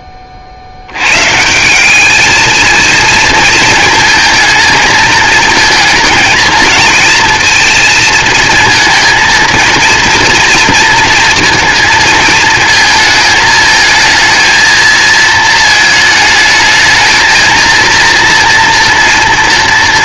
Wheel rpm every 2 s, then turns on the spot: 90, 230, 220, 230, 230, 230, 220, 220, 220, 230.
none